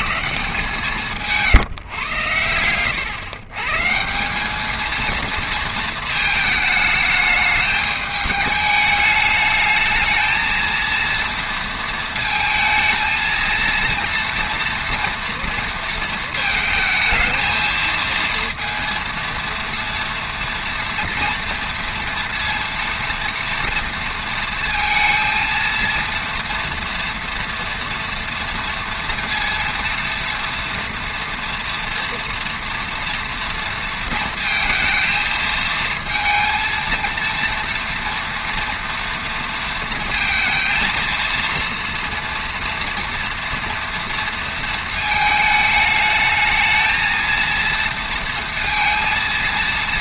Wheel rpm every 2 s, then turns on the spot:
160, 110, 200, 220, 210, 230, 230, 230, 230, 230, 230, 230, 230, 230, 230, 230, 230, 230, 230, 230, 230, 230, 230, 220, 230.
none